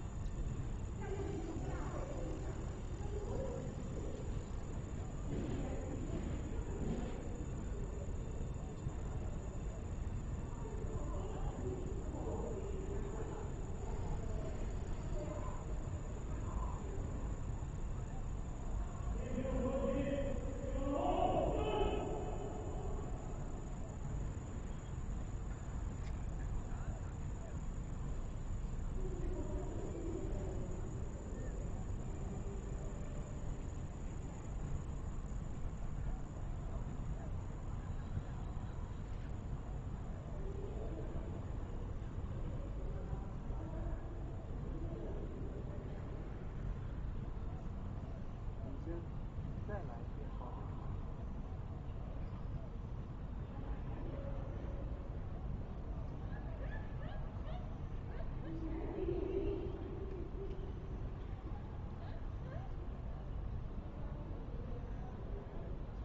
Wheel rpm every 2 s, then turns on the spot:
0, 0, 0, 0, 0, 0, 0, 0, 0, 0, 0, 0, 0, 0, 0, 0, 0, 0, 0, 0, 0, 0, 0, 0, 0, 0, 0, 0, 0, 0, 0, 0, 0.
none